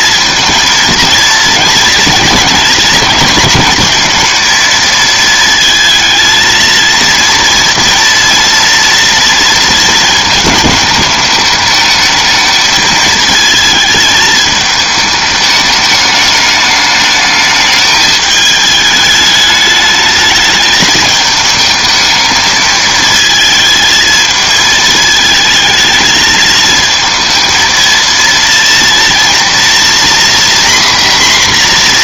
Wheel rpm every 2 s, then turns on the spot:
230, 230, 230, 230, 230, 210, 220, 210, 210, 210, 220, 220, 220, 220, 230, 250.
none